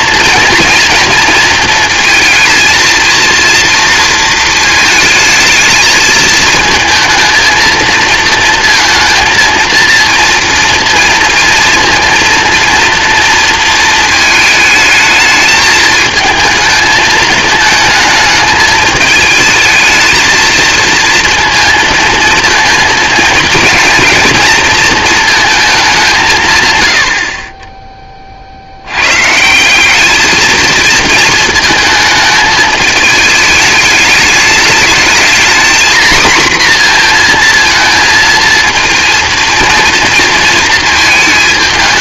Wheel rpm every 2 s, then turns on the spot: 230, 230, 220, 230, 230, 230, 230, 220, 220, 220, 230, 230, 230, 100, 80, 230, 220, 210, 240, 230, 230.
none